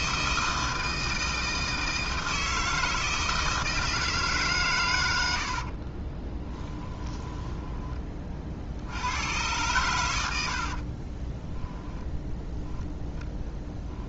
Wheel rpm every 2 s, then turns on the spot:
160, 160, 130, 20, 60, 60, 0.
6-8